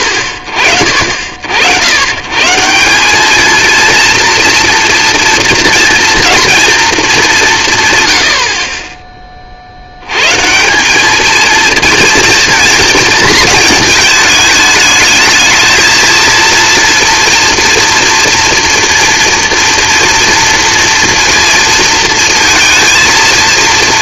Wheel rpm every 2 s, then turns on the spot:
50, 160, 230, 230, 40, 170, 230, 220, 230, 240, 230, 220.
none